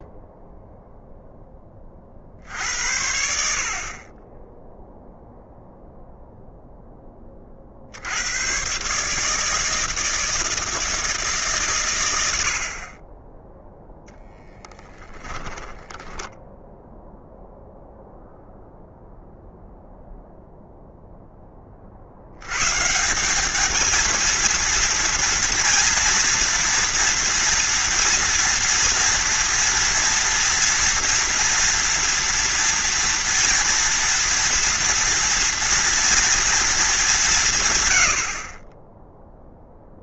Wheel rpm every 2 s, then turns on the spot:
0, 70, 0, 10, 130, 160, 50, 10, 0, 0, 0, 130, 230, 230, 240, 240, 230, 230, 220, 30.
14-16